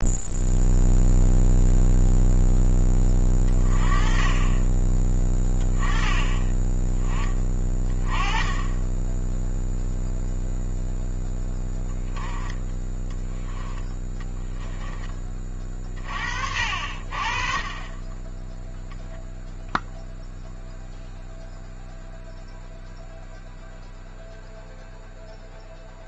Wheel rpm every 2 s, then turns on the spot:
0, 10, 20, 10, 20, 0, 10, 10, 60, 0, 0, 0, 0.
none